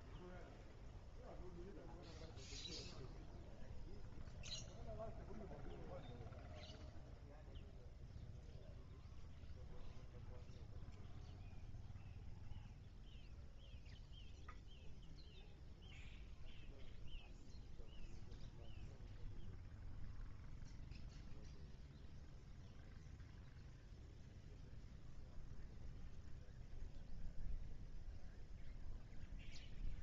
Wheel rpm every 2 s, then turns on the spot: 0, 0, 0, 0, 0, 0, 0, 0, 0, 0, 0, 0, 0, 0, 0.
none